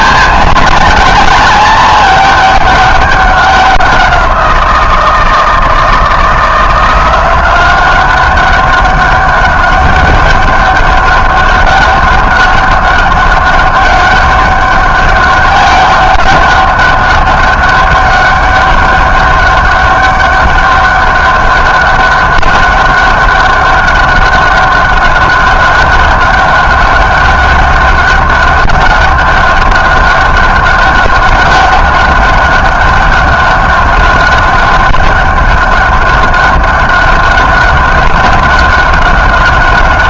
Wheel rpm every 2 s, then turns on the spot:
220, 200, 170, 170, 190, 200, 200, 200, 200, 200, 200, 200, 200, 200, 200, 200, 200, 200, 200, 200.
none